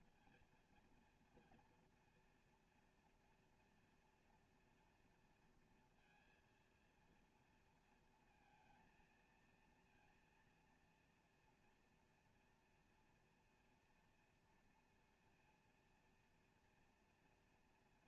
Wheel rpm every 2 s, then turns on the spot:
240, 230, 230, 230, 220, 230, 230, 230, 230.
none